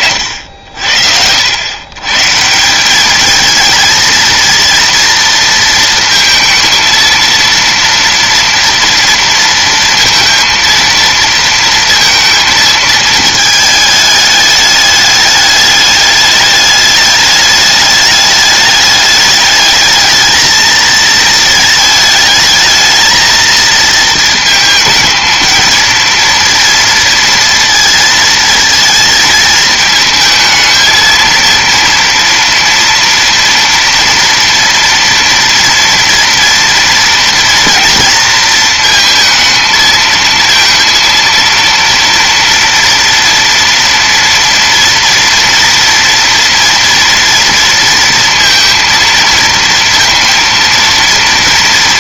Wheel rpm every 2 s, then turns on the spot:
60, 190, 230, 230, 230, 230, 220, 210, 210, 210, 220, 220, 220, 230, 220, 220, 230, 230, 230, 230, 230, 230, 230, 230, 230, 230.
none